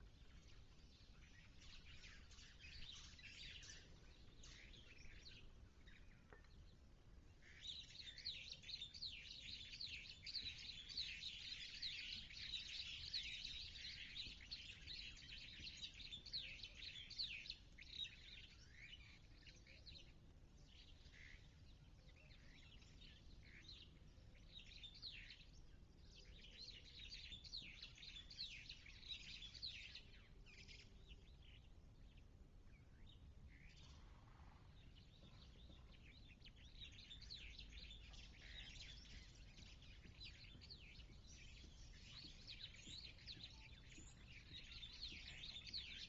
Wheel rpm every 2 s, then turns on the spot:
0, 0, 0, 0, 0, 0, 0, 0, 0, 0, 0, 0, 0, 0, 0, 0, 0, 0, 0, 0, 0, 0, 20.
none